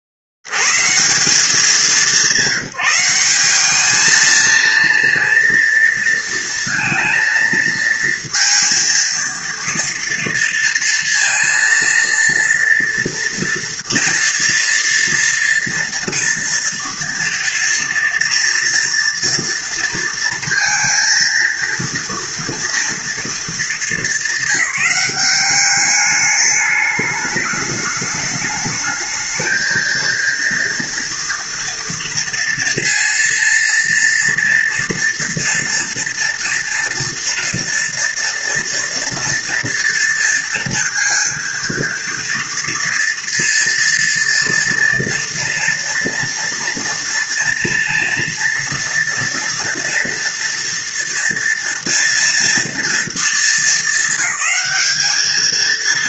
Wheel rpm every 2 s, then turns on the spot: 70, 190, 230, 230, 230, 230, 230, 230, 230, 240, 230, 230, 210, 210, 210, 230, 230, 230, 230, 230, 230, 230, 230, 230, 230, 230, 230, 200.
none